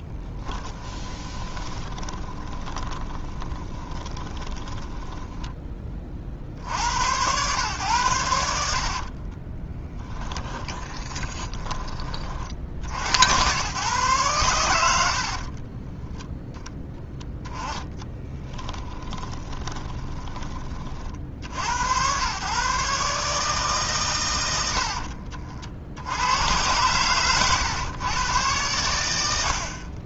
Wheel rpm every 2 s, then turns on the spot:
10, 30, 10, 70, 40, 10, 60, 90, 0, 10, 40, 130, 80, 110, 90.
0-6 10-12 18-20 24-26